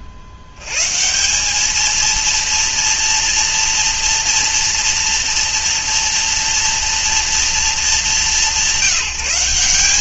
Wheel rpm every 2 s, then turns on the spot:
60, 230, 230, 230, 170.
none